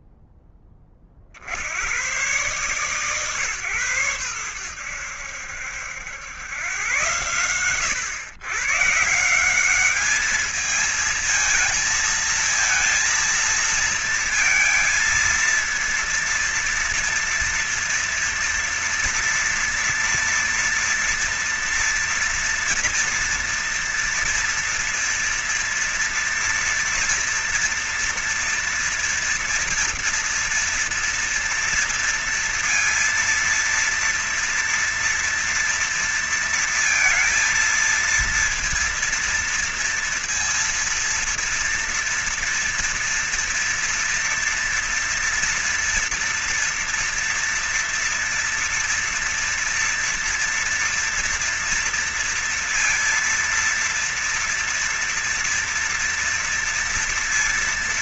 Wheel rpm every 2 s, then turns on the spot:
10, 110, 100, 100, 130, 210, 220, 230, 230, 230, 230, 230, 230, 240, 230, 230, 230, 230, 230, 230, 230, 230, 240, 230, 230, 230, 230, 230, 230.
none